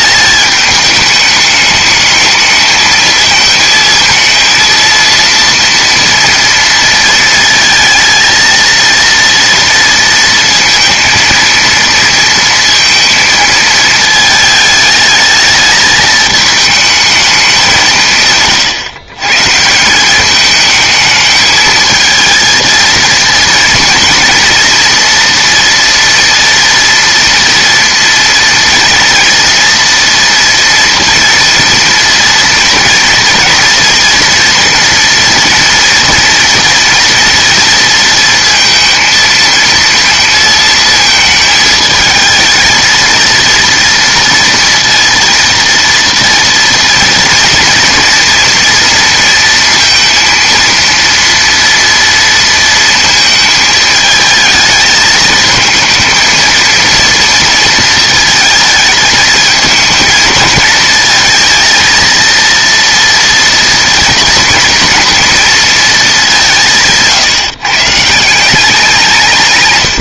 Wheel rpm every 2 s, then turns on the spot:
210, 220, 230, 230, 230, 230, 230, 220, 210, 140, 210, 230, 240, 230, 240, 230, 230, 230, 240, 230, 220, 220, 230, 230, 230, 230, 230, 220, 230, 220, 220, 230, 230, 190, 170.
none